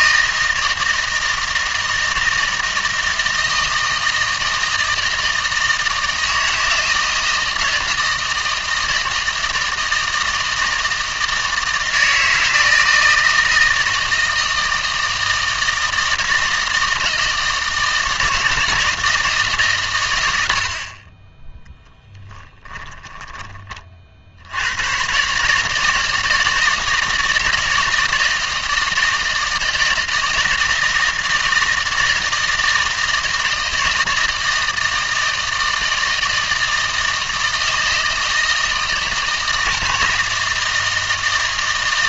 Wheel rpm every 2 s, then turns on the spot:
160, 160, 160, 160, 160, 160, 160, 160, 160, 160, 80, 10, 90, 160, 160, 160, 160, 160, 160, 160, 160.
22-24